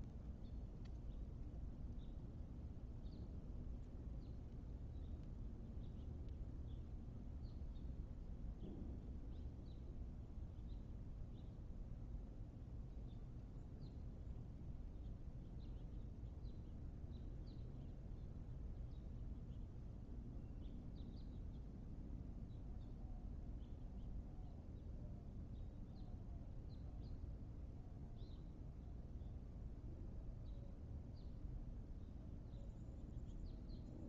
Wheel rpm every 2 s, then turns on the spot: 0, 0, 0, 0, 0, 0, 0, 0, 0, 0, 0, 0, 0, 0, 0, 0, 0.
none